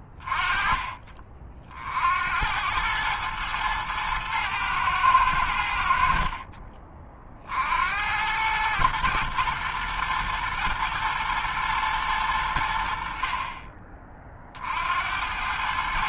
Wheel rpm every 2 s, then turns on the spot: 20, 80, 110, 50, 90, 120, 100, 40.
none